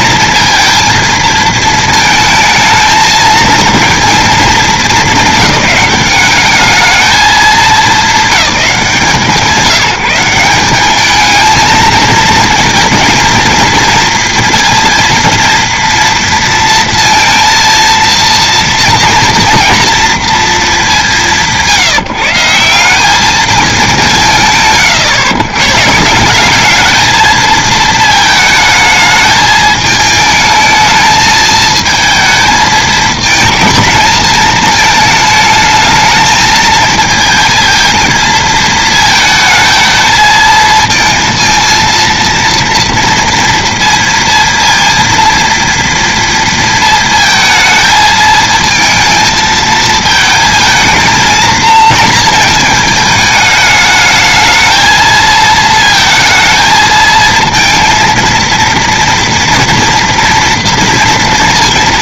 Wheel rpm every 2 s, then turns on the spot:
230, 220, 210, 210, 180, 200, 220, 230, 230, 230, 210, 180, 130, 210, 220, 220, 220, 220, 220, 220, 220, 230, 230, 230, 220, 220, 220, 220, 220, 230, 230.
none